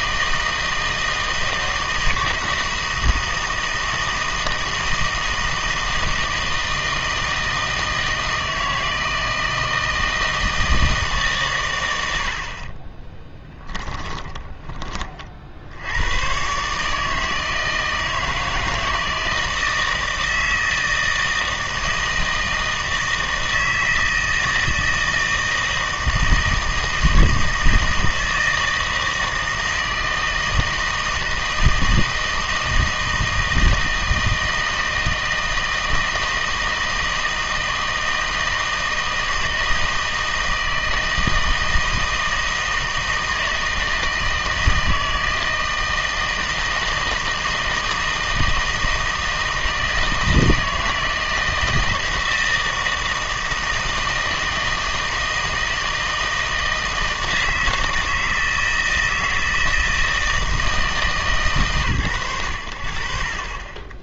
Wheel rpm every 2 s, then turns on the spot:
160, 170, 160, 160, 160, 160, 20, 20, 140, 160, 160, 160, 160, 160, 160, 160, 160, 160, 160, 160, 160, 160, 160, 160, 160, 160, 160, 160, 160, 160, 160, 70.
12-14